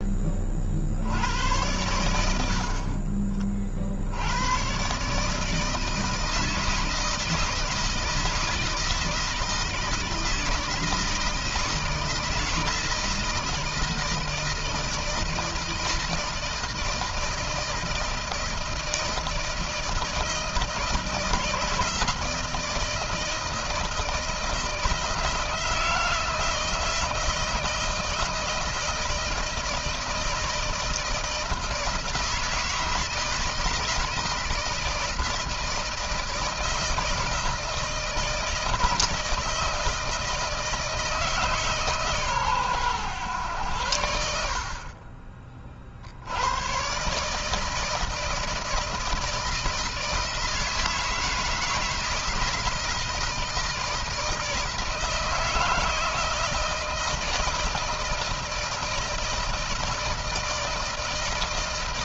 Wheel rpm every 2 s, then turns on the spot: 70, 50, 140, 160, 160, 160, 160, 160, 160, 160, 160, 160, 160, 160, 160, 160, 170, 160, 160, 160, 160, 120, 50, 130, 160, 160, 160, 160, 160, 160, 160.
2-4